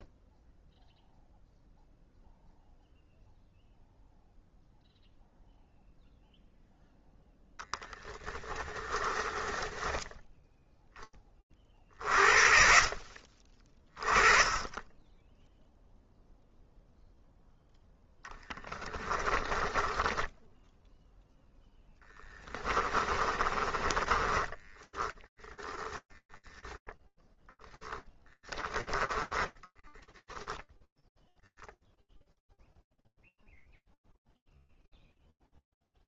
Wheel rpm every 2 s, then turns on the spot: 0, 0, 0, 0, 20, 10, 50, 20, 0, 20, 0, 30, 20, 0, 20, 0, 0, 0.
8-10 18-20 22-26 28-30